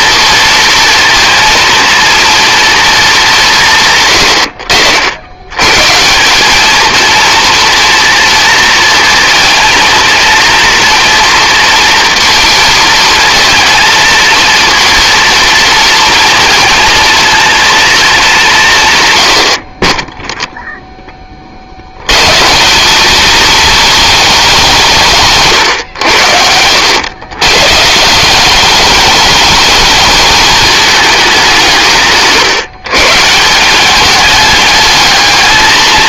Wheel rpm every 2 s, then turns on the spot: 230, 220, 70, 220, 230, 230, 220, 230, 230, 150, 0, 200, 210, 90, 200, 210, 140, 210.
none